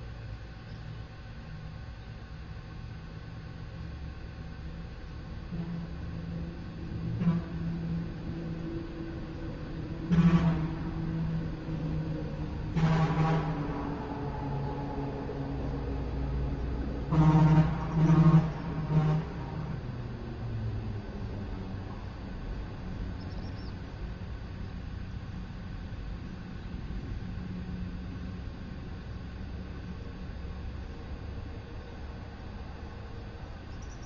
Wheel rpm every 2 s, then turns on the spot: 0, 0, 0, 0, 0, 0, 0, 0, 0, 0, 0, 0, 0, 0, 0, 0, 0.
none